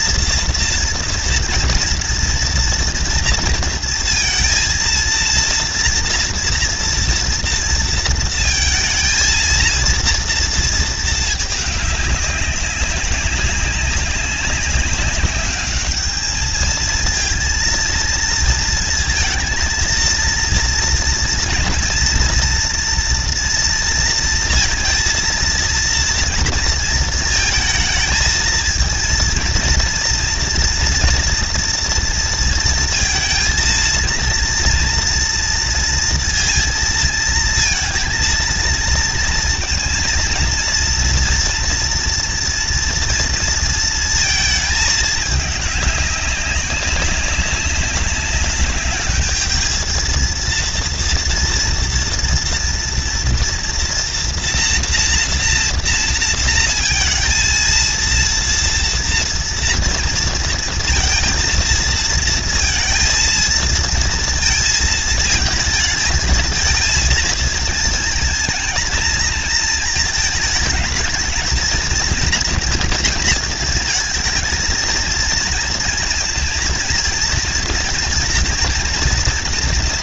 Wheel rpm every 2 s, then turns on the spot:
230, 230, 230, 230, 230, 230, 200, 200, 220, 230, 230, 230, 230, 230, 220, 230, 230, 230, 230, 230, 230, 240, 230, 200, 200, 230, 230, 230, 230, 230, 230, 230, 230, 220, 230, 220, 230, 230, 230, 230.
none